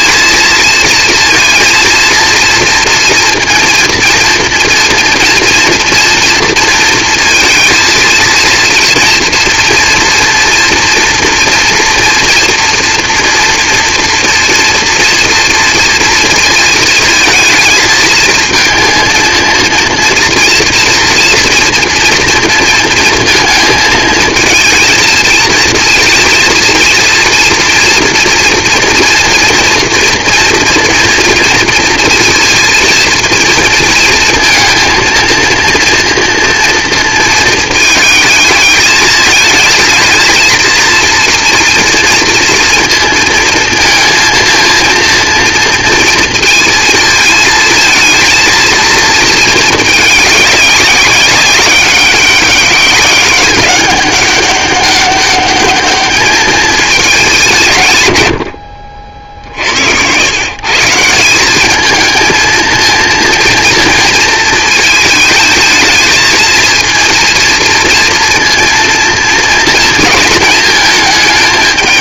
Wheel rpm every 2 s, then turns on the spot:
230, 230, 230, 230, 230, 230, 230, 230, 230, 230, 230, 230, 230, 230, 230, 230, 230, 230, 230, 220, 230, 230, 230, 230, 220, 200, 200, 200, 210, 60, 170, 230, 220, 230, 230, 220.
58-60